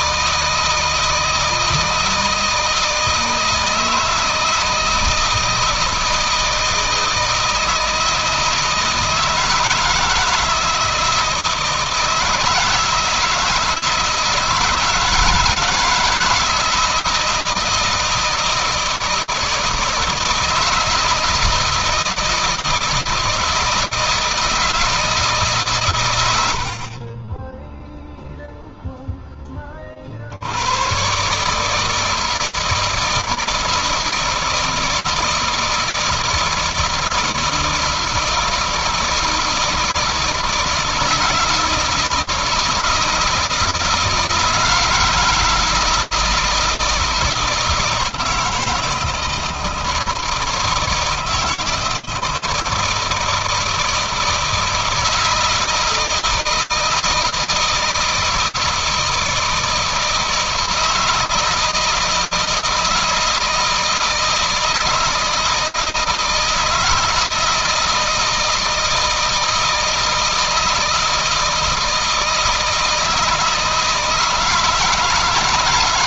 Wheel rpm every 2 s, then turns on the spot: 160, 160, 160, 160, 160, 160, 160, 160, 160, 160, 160, 160, 160, 50, 0, 110, 160, 160, 160, 160, 160, 160, 160, 160, 160, 160, 160, 160, 160, 160, 160, 160, 160, 160, 160, 160, 160, 160.
none